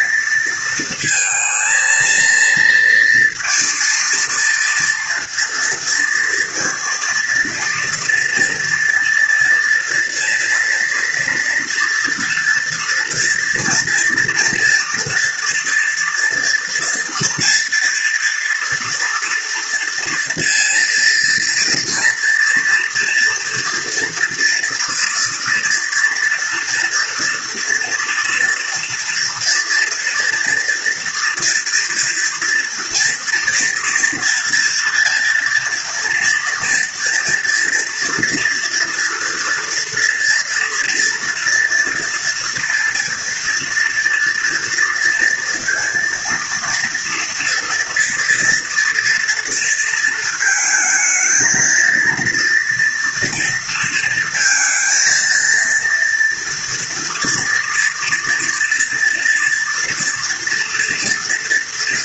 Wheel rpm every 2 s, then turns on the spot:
220, 230, 230, 230, 230, 230, 230, 230, 230, 230, 230, 240, 230, 230, 240, 230, 230, 230, 230, 230, 230, 240, 230, 230, 230, 220, 230, 230, 230, 230, 240.
none